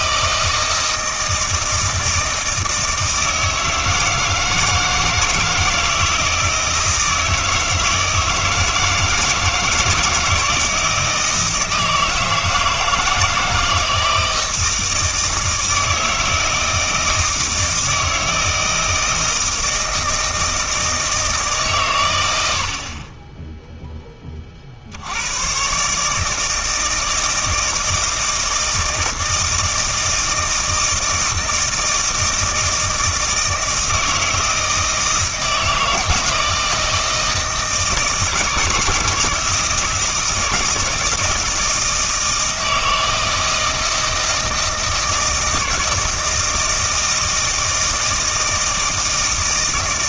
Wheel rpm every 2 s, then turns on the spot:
160, 160, 160, 160, 160, 160, 160, 160, 160, 160, 160, 70, 50, 160, 160, 160, 160, 160, 160, 160, 170, 160, 160, 160, 160.
none